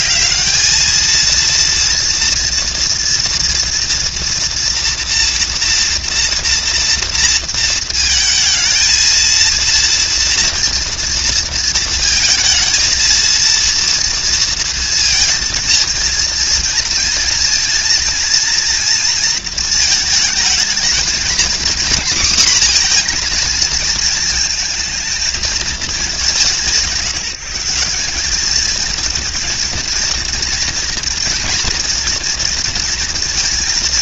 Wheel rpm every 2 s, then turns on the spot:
220, 230, 230, 230, 230, 230, 220, 230, 230, 230, 230, 240, 220, 170, 220, 230, 230.
none